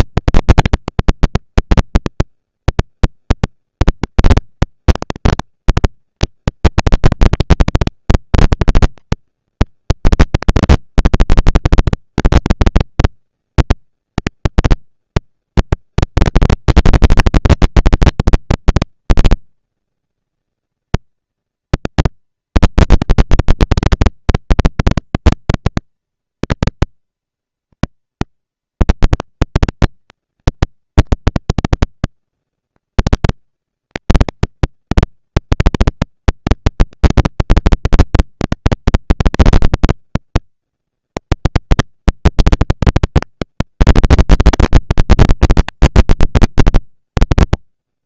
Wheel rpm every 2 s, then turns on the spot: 230, 200, 200, 200, 220, 230, 220, 230, 230, 230, 230, 230, 240, 230, 230, 230, 230, 230, 230, 230, 230, 230, 240, 180.
none